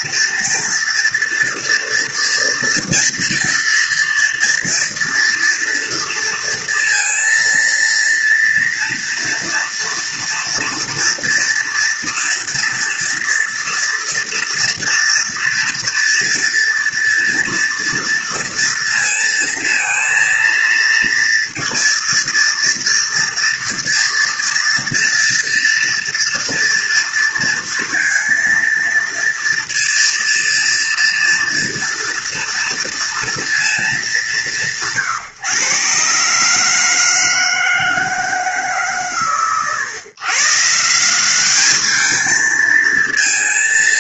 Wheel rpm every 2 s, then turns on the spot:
230, 230, 230, 230, 230, 230, 230, 230, 230, 230, 230, 230, 230, 230, 230, 230, 230, 160, 160, 140, 170, 220.
none